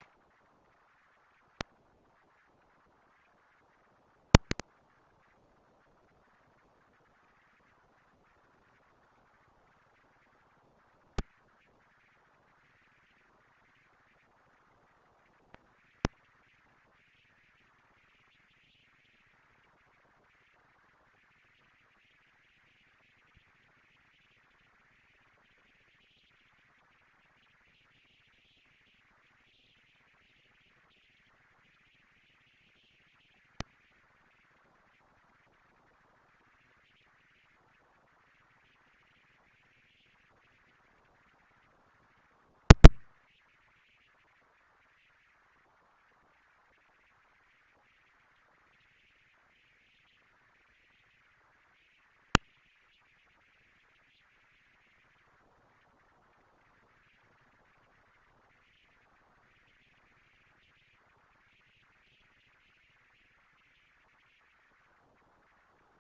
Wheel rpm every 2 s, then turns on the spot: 130, 230, 230, 220, 220, 230, 230, 230, 230, 230, 230, 170, 160, 170, 220, 230, 230, 230, 230, 230, 230, 230, 230, 230, 230, 230, 220, 220, 200, 160, 180, 230, 230.
none